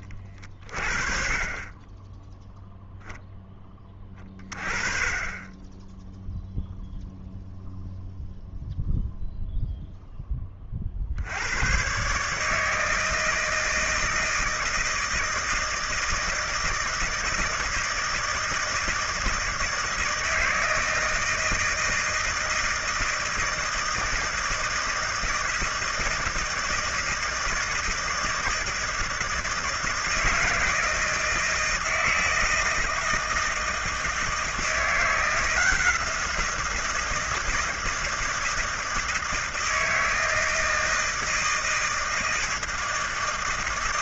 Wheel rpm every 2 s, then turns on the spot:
40, 0, 20, 0, 0, 40, 160, 160, 160, 160, 160, 160, 160, 160, 160, 160, 160, 170, 170, 160, 160, 160.
none